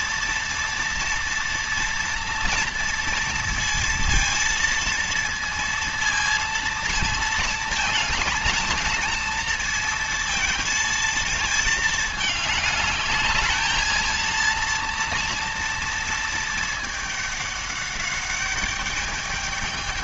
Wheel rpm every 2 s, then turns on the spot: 230, 230, 230, 230, 230, 230, 210, 230, 210, 210.
none